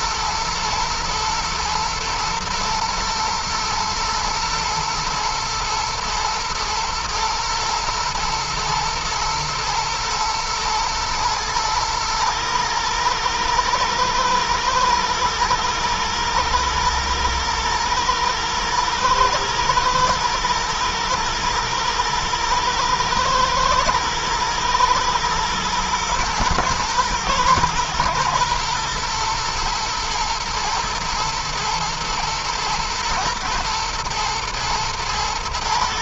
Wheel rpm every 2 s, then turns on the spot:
110, 120, 110, 120, 110, 110, 110, 110, 120, 110, 110, 110, 120, 120, 120, 120, 110, 120.
none